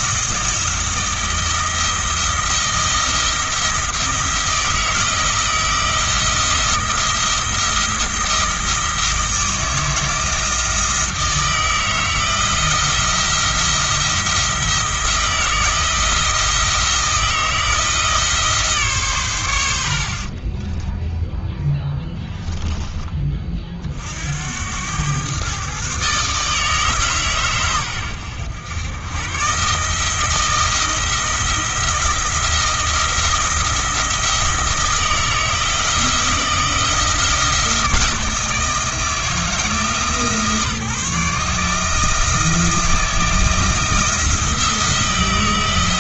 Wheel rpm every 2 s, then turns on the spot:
170, 170, 160, 170, 160, 160, 170, 170, 160, 150, 20, 10, 90, 150, 100, 170, 170, 160, 170, 160, 150, 160, 170.
20-22